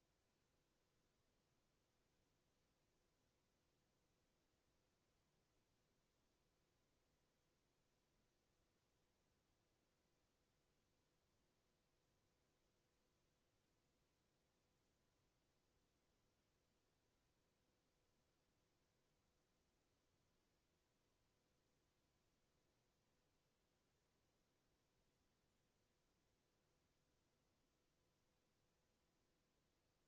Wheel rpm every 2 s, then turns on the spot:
0, 0, 0, 0, 0, 0, 0, 0, 0, 0, 0, 0, 0, 0, 0.
none